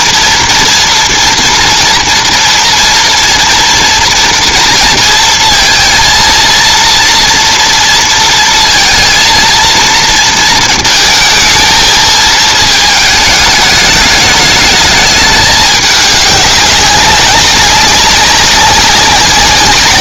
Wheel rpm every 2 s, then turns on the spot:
230, 230, 230, 230, 230, 220, 220, 210, 190, 190.
none